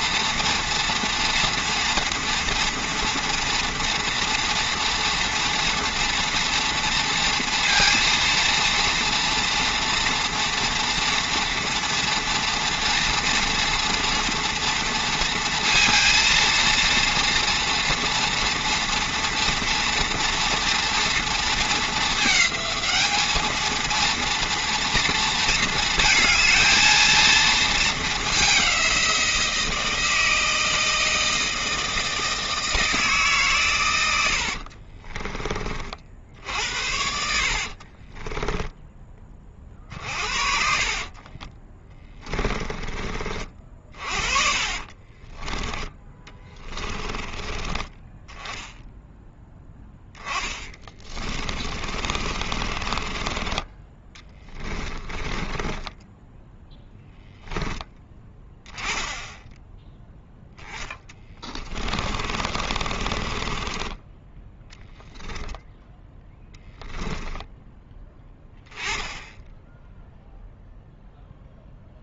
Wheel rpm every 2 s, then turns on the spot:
230, 230, 230, 230, 240, 230, 230, 230, 230, 230, 230, 210, 230, 220, 190, 160, 160, 40, 70, 10, 40, 20, 30, 20, 10, 20, 40, 20, 10, 10, 10, 40, 10, 10, 10, 0.
34-42 44-48 50-56 60-64 66-68